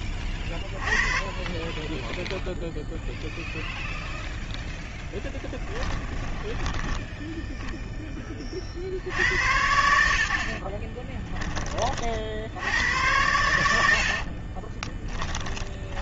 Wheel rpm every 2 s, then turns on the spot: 0, 10, 10, 50, 40, 70, 20, 70.
8-10 12-14